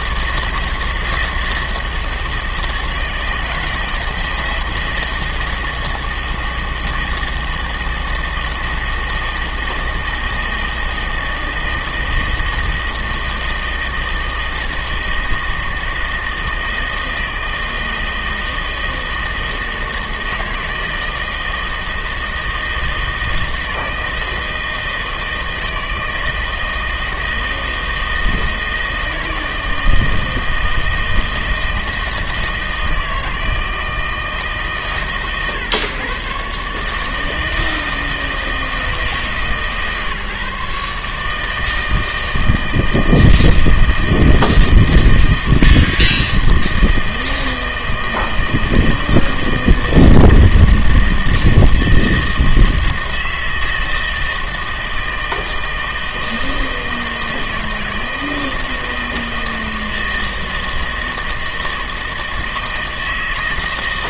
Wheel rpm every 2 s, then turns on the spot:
160, 160, 160, 160, 160, 160, 160, 160, 160, 160, 160, 160, 160, 160, 160, 160, 160, 130, 140, 160, 140, 160, 160, 160, 160, 160, 160, 160, 160, 160, 160, 160.
none